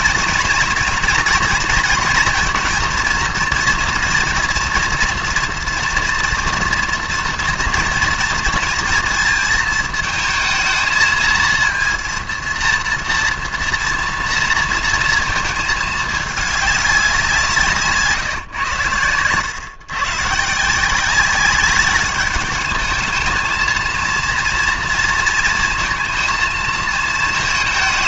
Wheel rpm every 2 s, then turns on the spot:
240, 230, 230, 230, 230, 220, 230, 230, 200, 120, 160, 210, 230, 230.
none